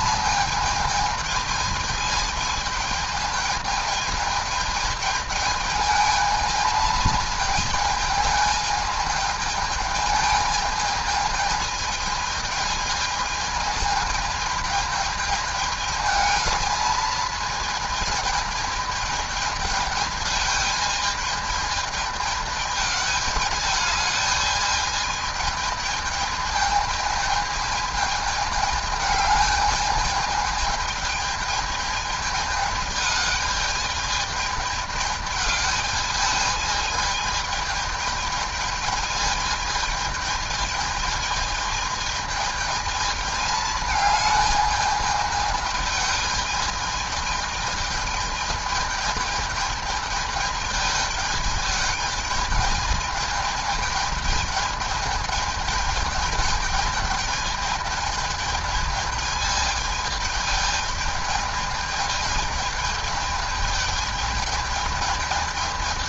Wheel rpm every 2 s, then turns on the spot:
220, 220, 220, 220, 220, 220, 220, 220, 220, 220, 220, 210, 220, 220, 220, 220, 220, 210, 210, 210, 210, 220, 210, 210, 210, 210, 210, 210, 210, 220, 210, 210, 220.
none